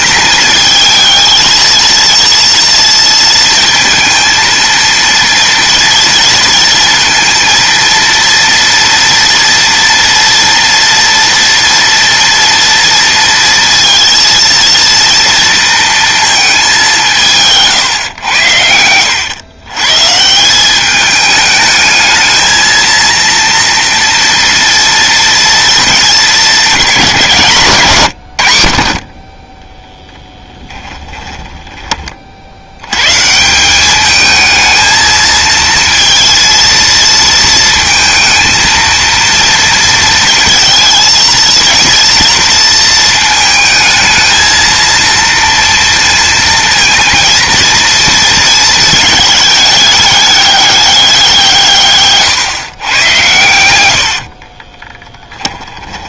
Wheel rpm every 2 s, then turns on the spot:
220, 230, 230, 230, 230, 230, 230, 230, 200, 80, 200, 230, 230, 200, 70, 10, 90, 220, 230, 230, 230, 230, 230, 230, 220, 200, 130, 20.
18-20 30-32 54-56